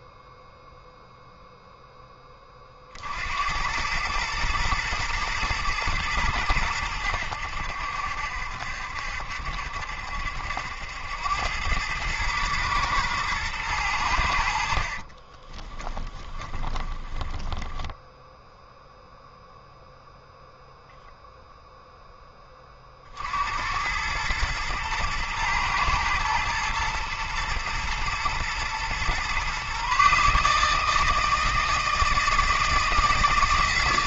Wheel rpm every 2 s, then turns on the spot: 0, 40, 120, 100, 70, 80, 110, 60, 20, 0, 0, 40, 110, 110, 120, 160, 160.
14-18